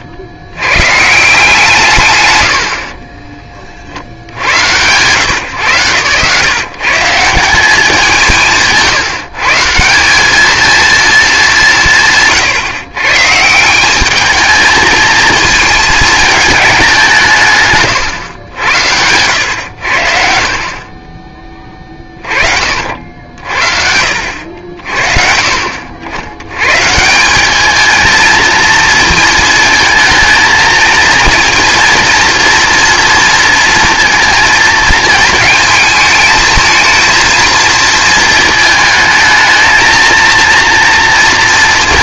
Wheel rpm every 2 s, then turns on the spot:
80, 100, 80, 140, 160, 220, 150, 220, 200, 90, 40, 50, 70, 120, 230, 220, 230, 230, 220, 220, 230.
none